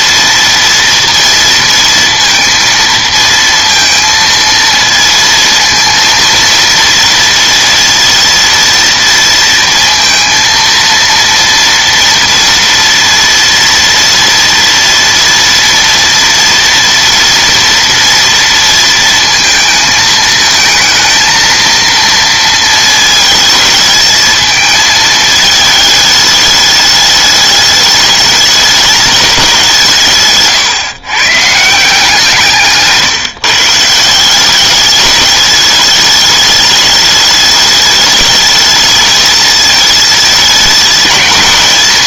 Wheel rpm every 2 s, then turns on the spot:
230, 230, 230, 230, 230, 230, 230, 230, 230, 230, 220, 230, 220, 210, 210, 140, 150, 200, 210, 210, 210.
none